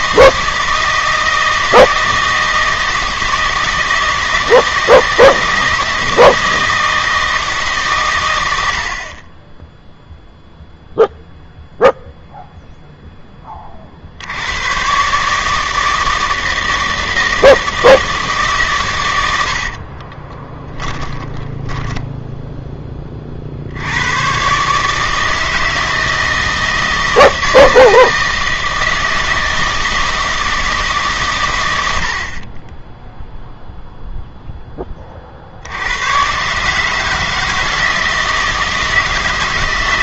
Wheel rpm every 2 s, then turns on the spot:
160, 160, 160, 160, 80, 0, 0, 110, 160, 140, 30, 10, 140, 160, 160, 160, 20, 10, 140, 160.
20-22